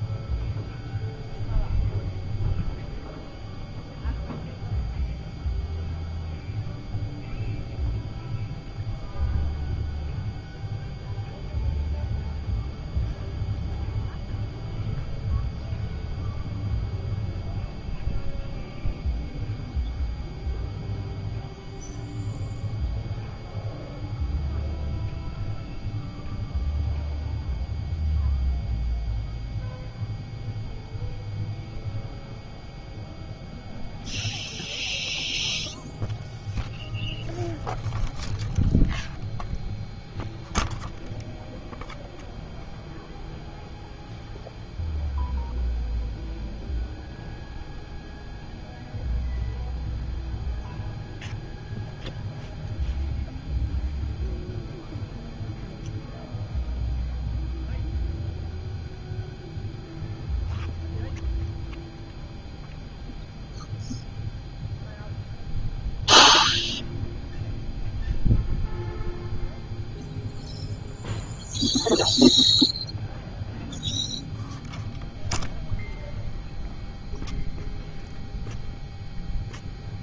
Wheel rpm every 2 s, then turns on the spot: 0, 0, 0, 0, 0, 0, 0, 0, 0, 0, 0, 0, 0, 0, 0, 0, 0, 0, 0, 0, 0, 0, 0, 0, 0, 0, 0, 0, 0, 0, 0, 0, 0, 0, 0, 0, 0, 0, 0, 0.
none